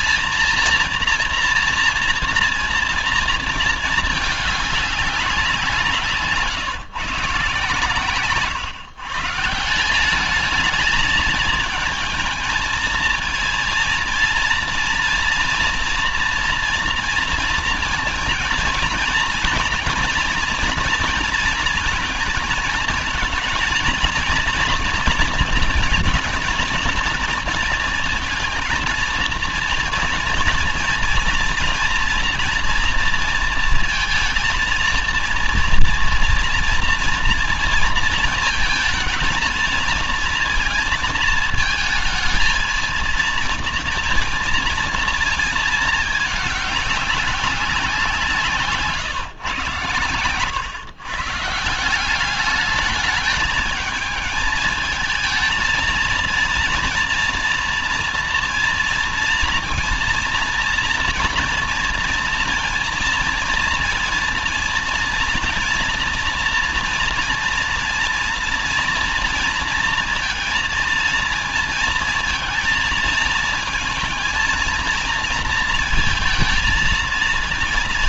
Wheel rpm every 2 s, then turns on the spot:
230, 230, 210, 150, 140, 210, 230, 230, 240, 230, 240, 220, 230, 220, 220, 230, 230, 230, 230, 220, 230, 220, 230, 210, 160, 120, 200, 220, 230, 230, 230, 230, 230, 230, 230, 230, 220, 230, 230.
none